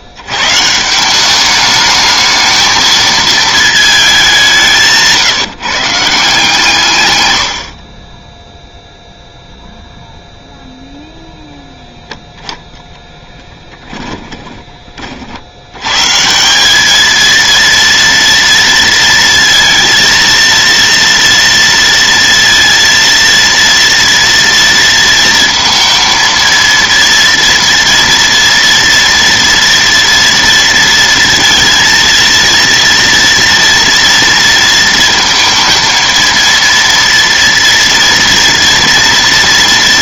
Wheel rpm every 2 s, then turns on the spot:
130, 220, 190, 150, 0, 0, 10, 20, 190, 230, 230, 230, 230, 230, 230, 230, 230, 230, 230, 230.
none